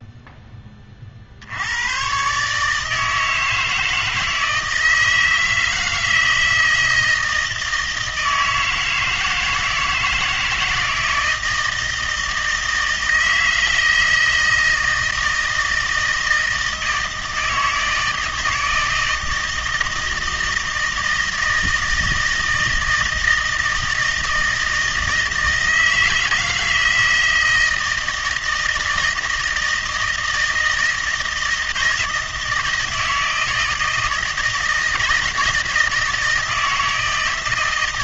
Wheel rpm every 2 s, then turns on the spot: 20, 150, 160, 160, 160, 160, 160, 160, 160, 160, 160, 160, 160, 160, 160, 160, 160, 160, 160.
none